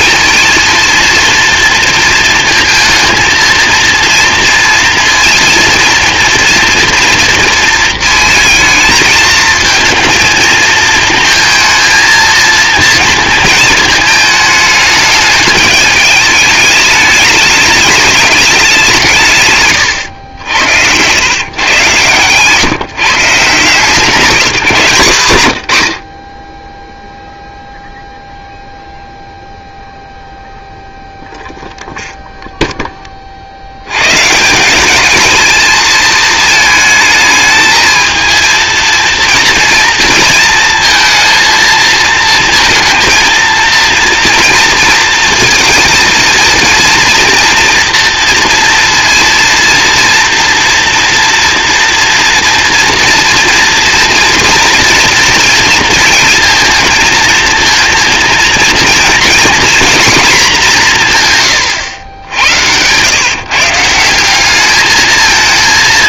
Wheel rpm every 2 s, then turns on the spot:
230, 230, 230, 230, 220, 220, 230, 220, 210, 190, 80, 150, 170, 10, 0, 0, 10, 180, 220, 220, 230, 230, 230, 230, 230, 230, 230, 230, 230, 230, 210, 90, 210.
none